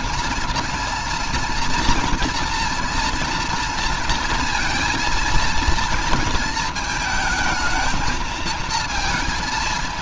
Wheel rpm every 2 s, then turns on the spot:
230, 240, 230, 220, 220.
none